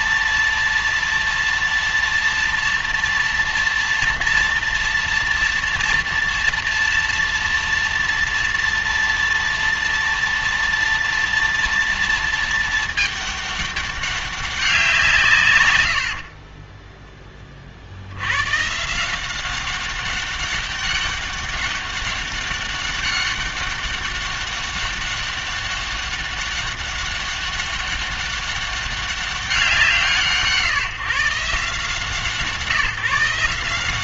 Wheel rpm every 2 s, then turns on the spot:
240, 230, 230, 240, 230, 230, 220, 180, 20, 140, 200, 200, 200, 200, 200, 150, 160.
16-18